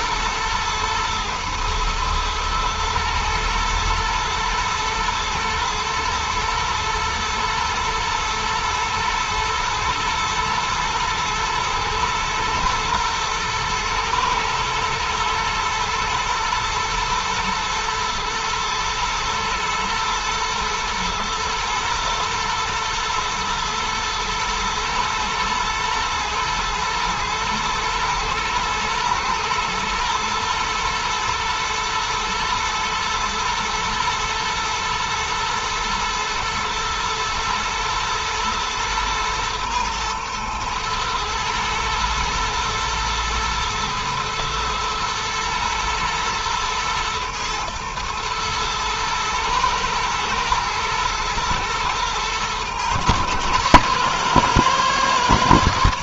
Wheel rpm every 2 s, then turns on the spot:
120, 120, 120, 110, 120, 110, 110, 120, 120, 110, 120, 110, 120, 110, 110, 120, 110, 110, 110, 110, 120, 110, 110, 110, 120, 110, 120, 130.
none